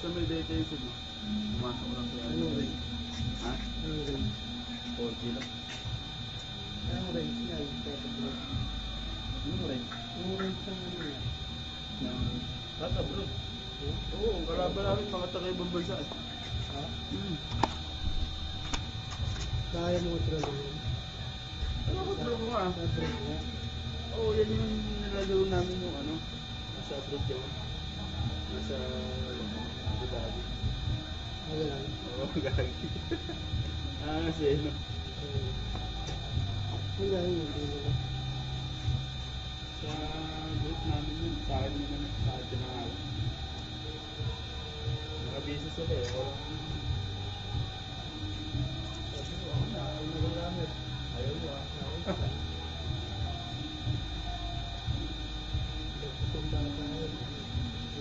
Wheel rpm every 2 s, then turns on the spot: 0, 0, 0, 0, 0, 0, 0, 0, 0, 0, 0, 0, 0, 0, 0, 0, 0, 0, 0, 0, 0, 0, 0, 0, 0, 0, 0, 0, 0.
none